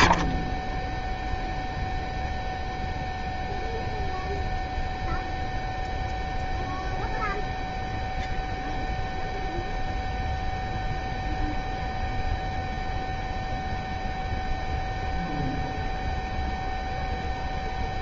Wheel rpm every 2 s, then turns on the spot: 30, 0, 0, 0, 0, 0, 0, 0, 0.
none